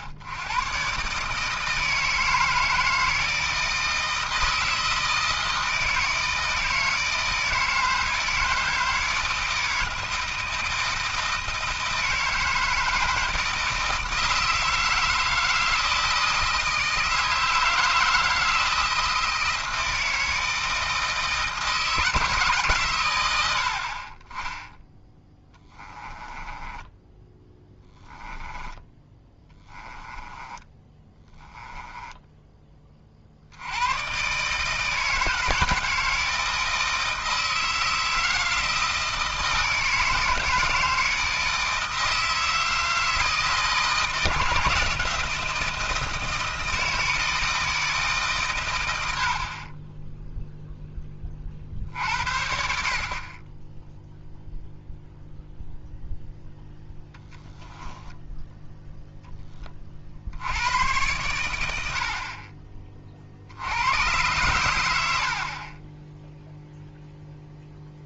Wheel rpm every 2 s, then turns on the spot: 120, 160, 160, 160, 160, 160, 160, 160, 160, 160, 160, 140, 10, 10, 10, 10, 20, 150, 160, 160, 160, 160, 160, 160, 120, 0, 50, 0, 0, 0, 90, 20, 110, 0.
26-32